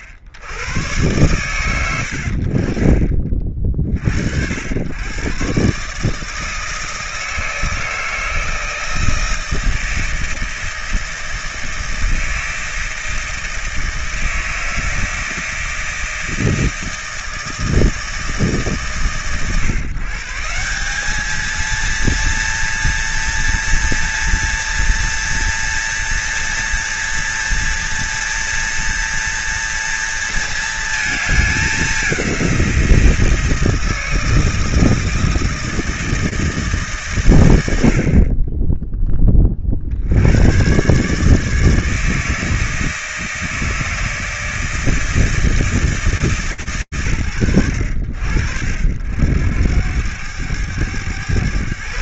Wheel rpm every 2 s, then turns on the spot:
50, 90, 60, 150, 160, 160, 160, 160, 160, 140, 160, 230, 230, 230, 230, 220, 180, 160, 150, 20, 140, 160, 160, 100, 80, 110.
none